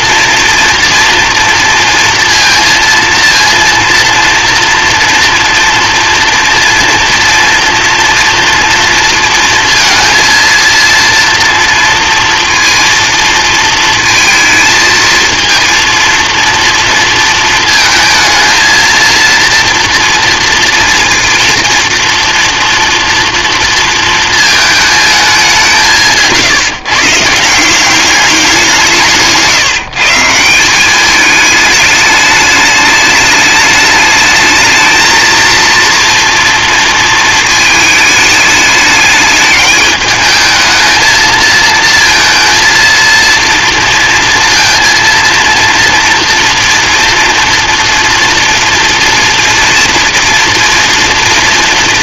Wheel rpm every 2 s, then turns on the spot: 230, 230, 230, 240, 240, 230, 230, 230, 230, 230, 230, 230, 220, 150, 180, 180, 210, 220, 230, 210, 220, 230, 230, 240, 240, 230.
none